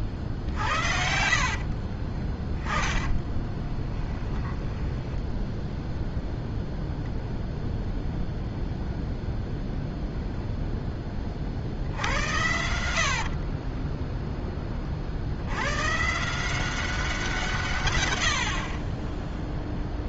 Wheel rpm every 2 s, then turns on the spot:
70, 20, 10, 0, 0, 0, 80, 20, 190, 60.
0-6